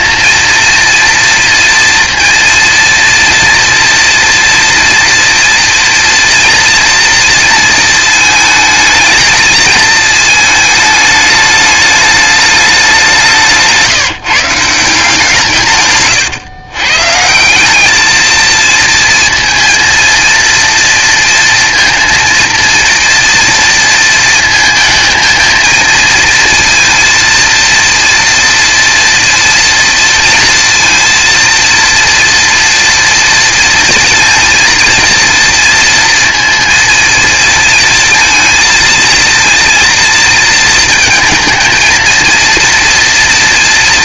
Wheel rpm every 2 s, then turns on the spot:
230, 230, 230, 230, 220, 220, 200, 160, 130, 230, 230, 230, 220, 230, 230, 230, 230, 230, 230, 230, 220, 230.
none